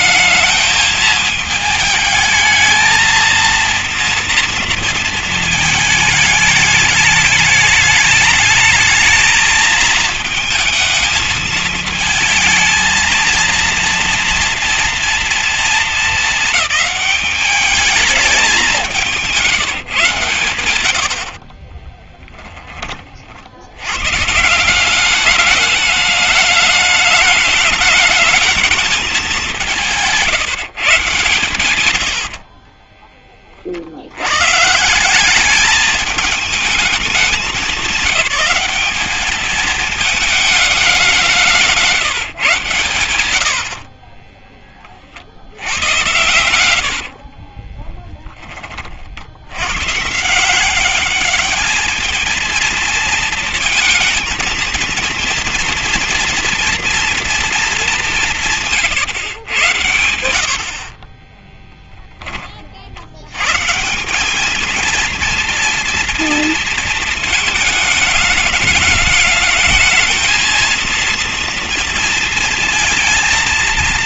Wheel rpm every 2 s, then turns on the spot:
220, 220, 230, 220, 220, 220, 220, 230, 210, 190, 90, 20, 180, 210, 210, 140, 40, 170, 210, 210, 190, 100, 30, 70, 50, 200, 230, 230, 230, 130, 40, 60, 220, 230, 220, 230, 230.
32-34 46-48 60-62